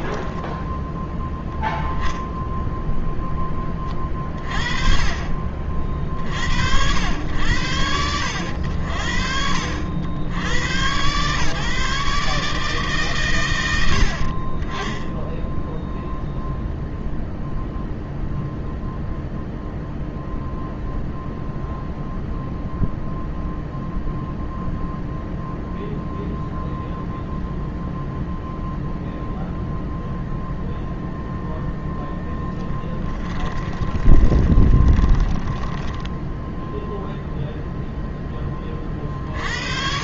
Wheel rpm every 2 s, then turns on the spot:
0, 10, 30, 90, 70, 110, 130, 10, 0, 0, 0, 0, 0, 0, 0, 0, 20, 20, 0, 40.
32-36